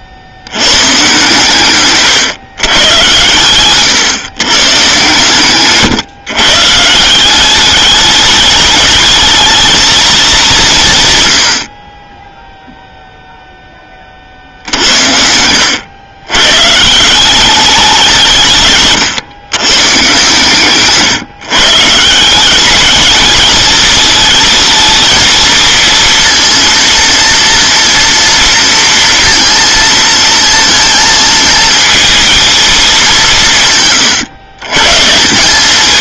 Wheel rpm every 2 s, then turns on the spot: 110, 120, 130, 150, 210, 160, 0, 60, 140, 140, 130, 190, 230, 230, 230, 230, 220, 130.
18-20